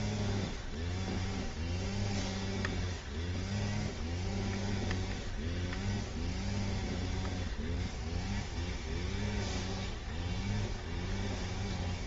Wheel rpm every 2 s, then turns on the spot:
0, 0, 0, 0, 0, 0.
none